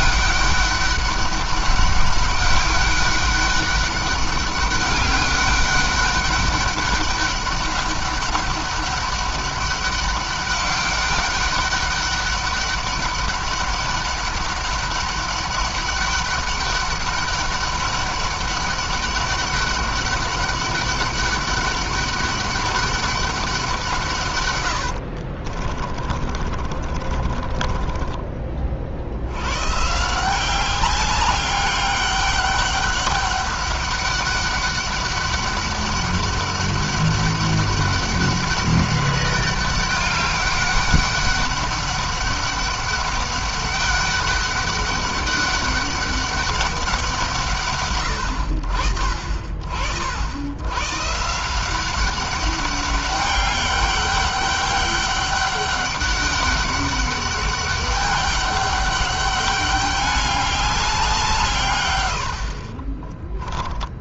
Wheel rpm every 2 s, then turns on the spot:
200, 200, 200, 200, 200, 200, 200, 200, 190, 200, 200, 200, 80, 40, 60, 190, 200, 200, 200, 200, 200, 200, 200, 190, 60, 130, 200, 200, 200, 200, 190, 30.
24-28 62-64